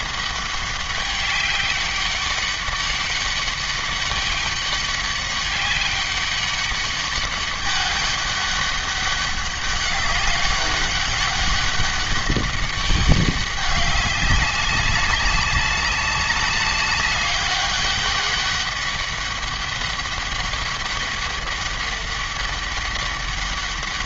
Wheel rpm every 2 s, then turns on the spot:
200, 200, 200, 200, 200, 190, 200, 200, 200, 200, 200, 200.
none